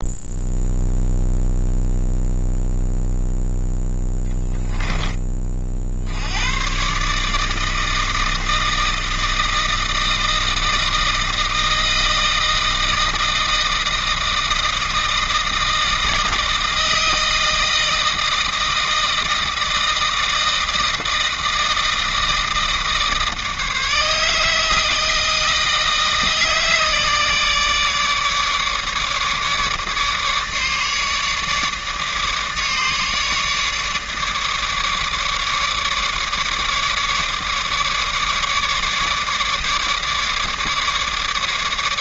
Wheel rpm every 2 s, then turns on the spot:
0, 0, 10, 120, 160, 160, 160, 160, 160, 160, 160, 160, 160, 150, 150, 150, 150, 150, 150, 150, 150.
none